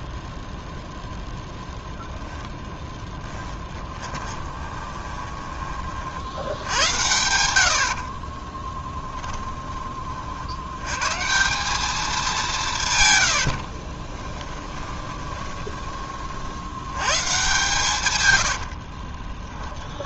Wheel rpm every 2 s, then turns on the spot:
0, 0, 20, 80, 20, 80, 170, 20, 80, 80.
4-6 8-10 14-16 18-20